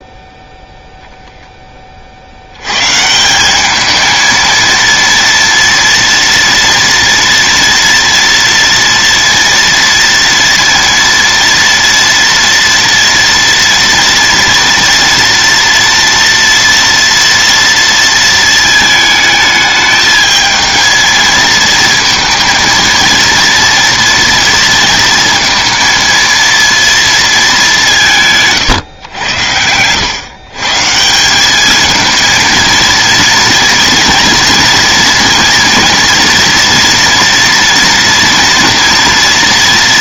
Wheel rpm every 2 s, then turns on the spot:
0, 130, 230, 230, 230, 230, 230, 230, 230, 220, 220, 230, 230, 230, 130, 150, 230, 230, 230, 230.
none